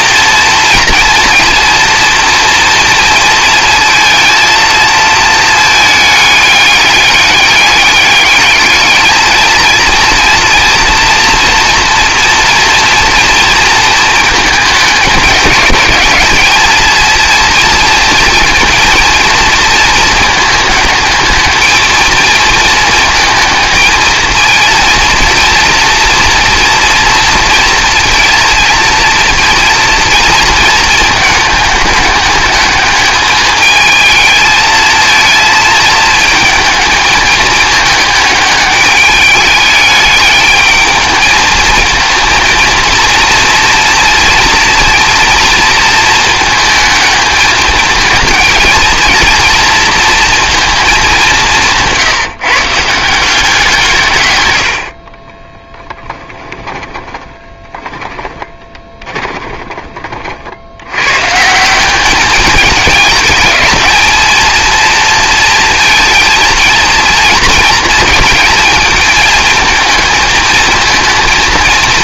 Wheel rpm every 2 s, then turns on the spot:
240, 230, 230, 200, 210, 230, 240, 210, 220, 230, 220, 220, 230, 230, 230, 220, 210, 220, 220, 210, 220, 230, 240, 220, 220, 220, 150, 80, 20, 20, 90, 210, 230, 230, 220, 230.
56-60